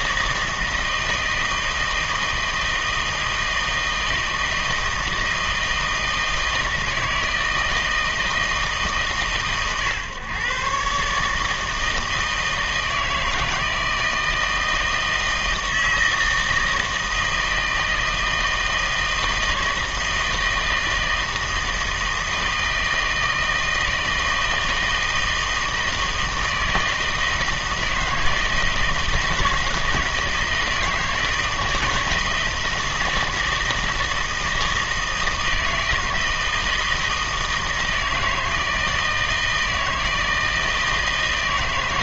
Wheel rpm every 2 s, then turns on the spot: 160, 160, 160, 160, 160, 130, 160, 160, 160, 160, 160, 160, 160, 160, 160, 160, 160, 160, 160, 160, 160.
none